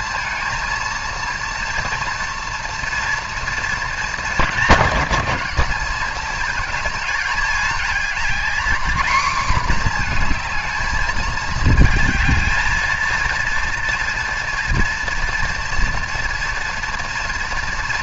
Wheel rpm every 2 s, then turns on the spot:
230, 240, 210, 220, 240, 220, 230, 230, 230.
none